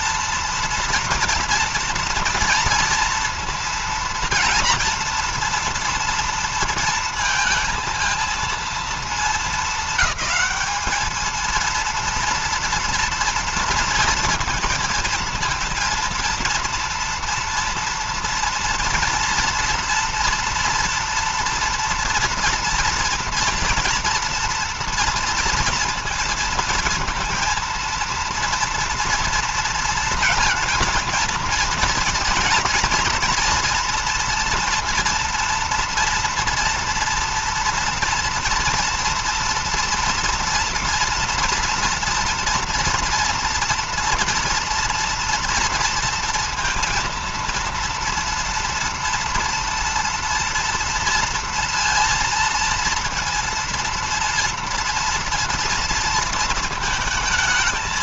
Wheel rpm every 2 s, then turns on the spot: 240, 230, 230, 230, 230, 210, 230, 230, 230, 230, 230, 230, 230, 230, 230, 230, 220, 230, 230, 230, 230, 230, 230, 230, 230, 230, 230, 230, 230.
none